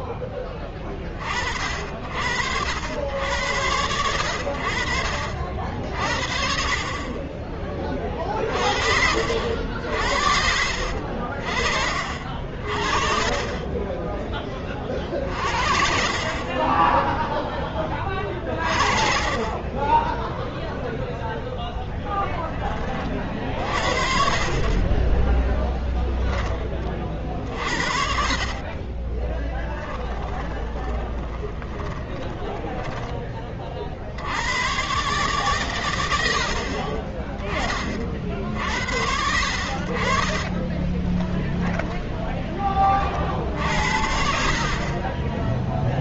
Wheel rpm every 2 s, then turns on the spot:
20, 70, 60, 30, 50, 60, 40, 30, 20, 30, 0, 30, 20, 30, 30, 20, 10, 120, 30, 80, 20, 40, 40.
6-8 16-18 24-32 40-42